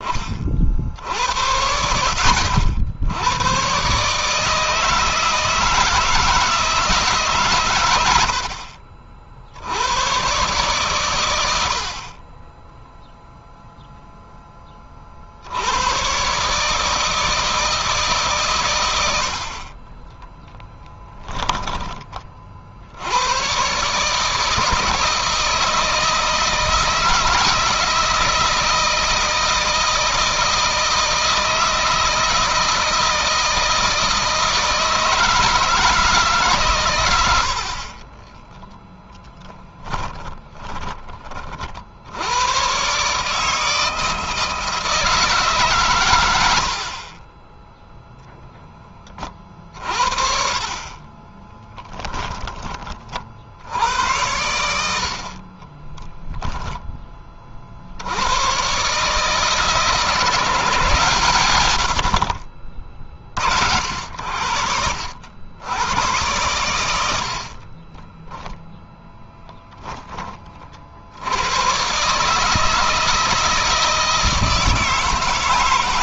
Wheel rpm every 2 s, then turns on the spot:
60, 80, 160, 160, 50, 130, 10, 30, 150, 100, 20, 60, 160, 160, 160, 160, 160, 160, 120, 10, 20, 130, 160, 60, 20, 30, 40, 80, 20, 140, 160, 40, 70, 80, 10, 50, 160, 160.
12-14 20-22 38-40 46-48 68-70